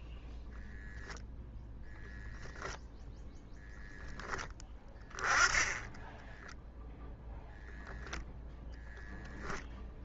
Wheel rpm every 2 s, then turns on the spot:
0, 10, 10, 0, 0.
none